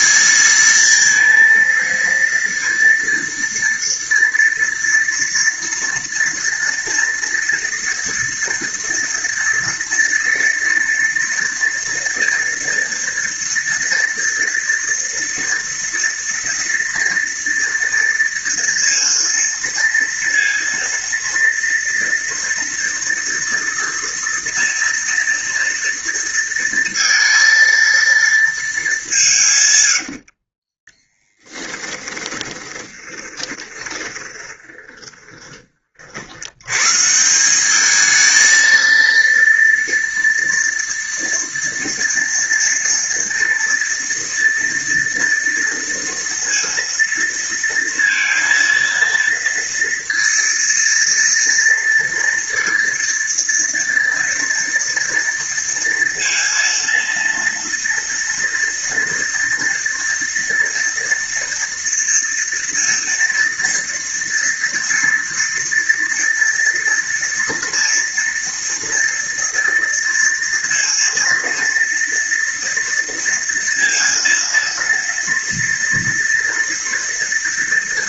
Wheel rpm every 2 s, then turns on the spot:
220, 230, 230, 230, 230, 230, 230, 230, 230, 230, 230, 230, 230, 230, 220, 20, 10, 20, 100, 220, 230, 230, 230, 230, 230, 230, 230, 230, 230, 230, 230, 230, 240, 230, 230, 230, 230, 230, 230.
30-36